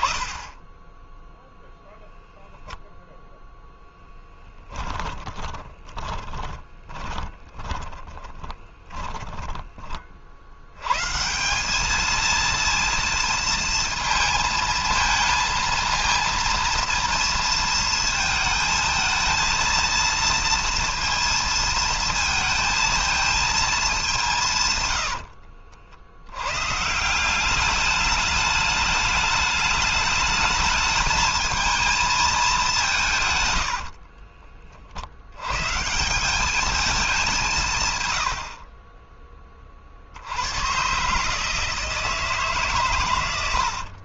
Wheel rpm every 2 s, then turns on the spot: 10, 0, 20, 20, 20, 120, 230, 220, 230, 220, 230, 230, 80, 170, 210, 220, 160, 60, 190, 30, 130, 110.
4-10 24-26